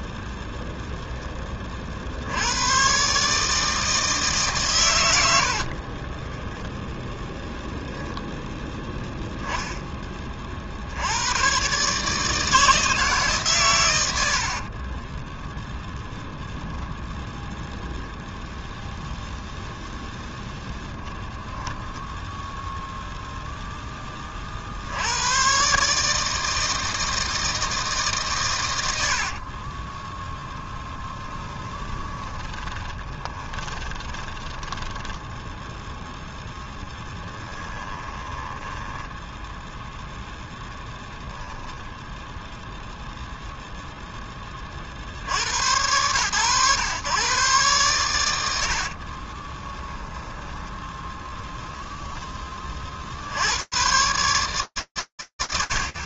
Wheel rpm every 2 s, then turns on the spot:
0, 100, 130, 10, 0, 70, 160, 50, 0, 0, 20, 0, 60, 160, 90, 20, 20, 10, 0, 10, 0, 0, 30, 120, 50, 10, 60, 100.
6-8 14-16 20-22 30-36 38-40 48-52